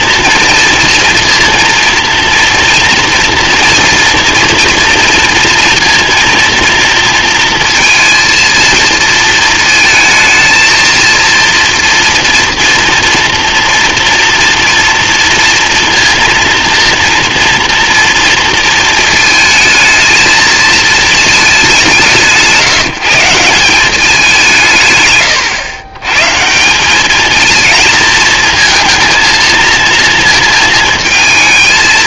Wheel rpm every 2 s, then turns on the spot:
230, 230, 230, 230, 230, 230, 230, 230, 230, 230, 220, 170, 160, 170, 230, 230.
none